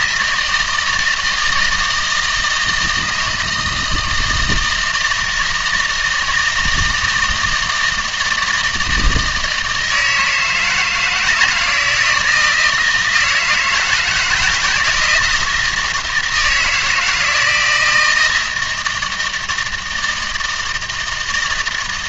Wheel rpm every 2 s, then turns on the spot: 160, 160, 160, 160, 160, 160, 160, 170, 160, 160, 160.
none